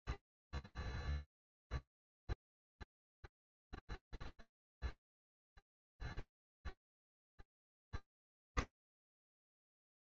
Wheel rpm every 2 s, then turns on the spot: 0, 0, 0, 0, 80.
none